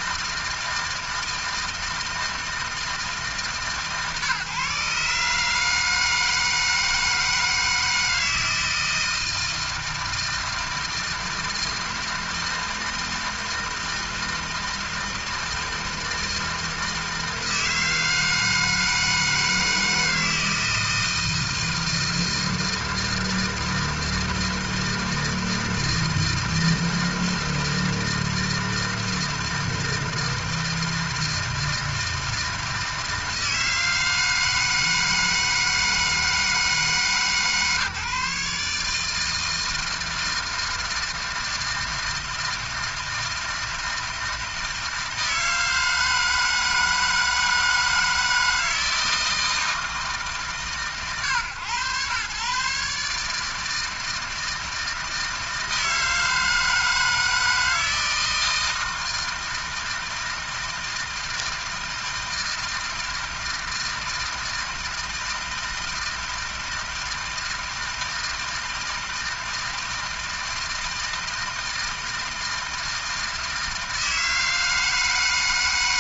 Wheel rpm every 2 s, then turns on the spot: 160, 160, 150, 160, 160, 160, 160, 160, 160, 160, 160, 160, 160, 160, 160, 160, 160, 160, 160, 150, 160, 160, 160, 160, 160, 120, 140, 160, 160, 160, 160, 160, 160, 160, 160, 160, 160, 160.
none